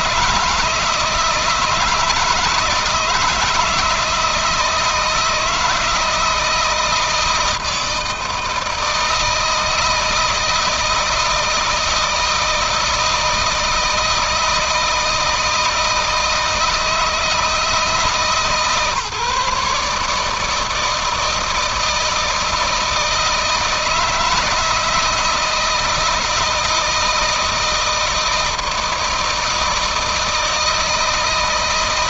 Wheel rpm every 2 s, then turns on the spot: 160, 160, 160, 160, 160, 160, 160, 160, 160, 140, 160, 160, 160, 160, 160, 160.
none